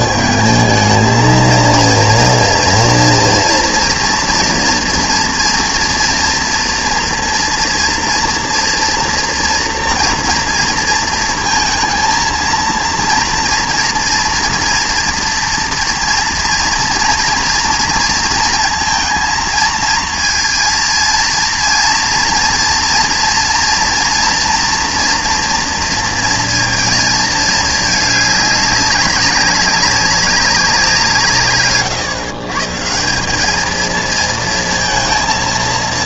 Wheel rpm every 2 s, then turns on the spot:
220, 230, 230, 230, 240, 230, 230, 230, 230, 230, 230, 230, 230, 230, 200, 180, 160, 230.
none